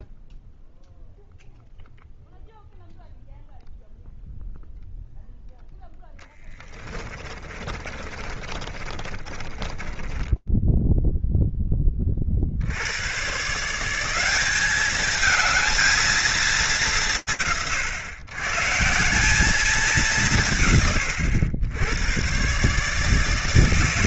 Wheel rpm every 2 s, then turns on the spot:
0, 0, 0, 20, 30, 10, 100, 210, 160, 160, 120, 150.
6-10